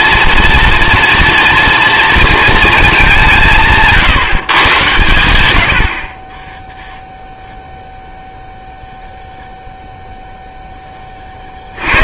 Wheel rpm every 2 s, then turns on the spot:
230, 230, 130, 0, 0, 10.
none